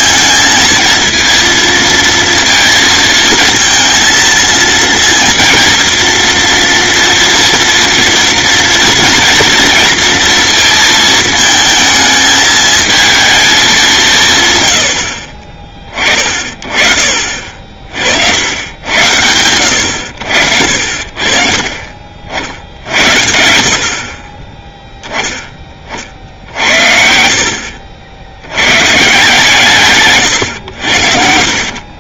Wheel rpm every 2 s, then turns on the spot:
230, 230, 230, 230, 240, 230, 220, 110, 40, 80, 50, 70, 20, 70, 100, 110.
26-28